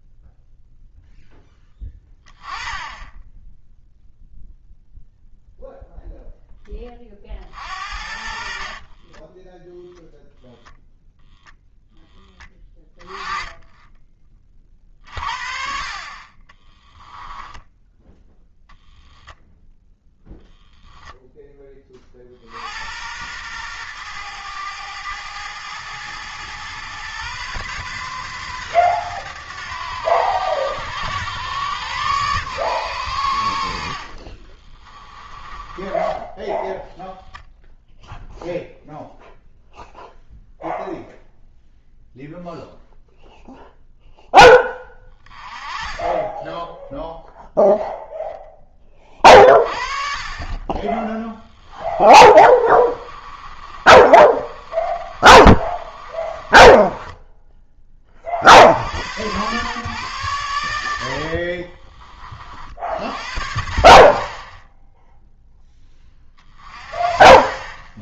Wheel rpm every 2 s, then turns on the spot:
0, 10, 0, 20, 30, 0, 30, 40, 10, 0, 0, 80, 110, 120, 120, 100, 120, 30, 0, 0, 0, 0, 10, 0, 20, 20, 30, 30, 20, 80, 100, 60, 10, 30.
8-10 16-18 34-36 50-58